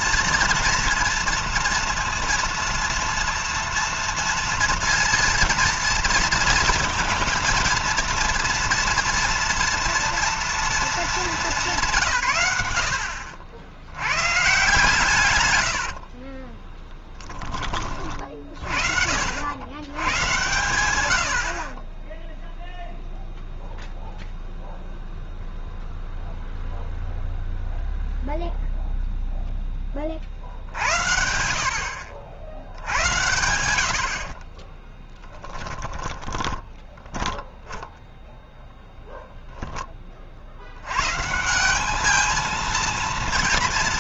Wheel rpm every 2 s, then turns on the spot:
230, 230, 230, 230, 230, 220, 90, 140, 20, 70, 100, 0, 0, 0, 0, 70, 90, 20, 10, 0, 100, 220.
16-18 34-38